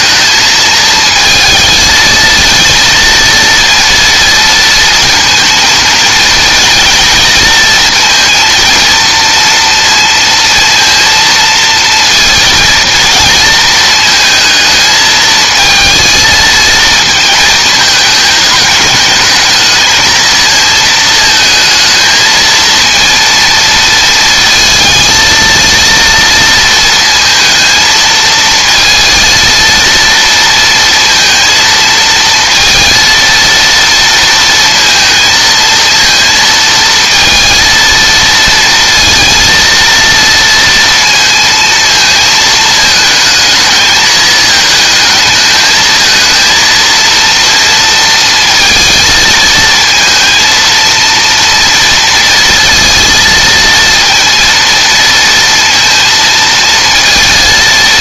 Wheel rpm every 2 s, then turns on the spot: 220, 230, 230, 230, 230, 230, 230, 220, 230, 220, 220, 230, 230, 230, 230, 230, 230, 230, 230, 230, 230, 220, 220, 230, 230, 230, 230, 230, 230.
none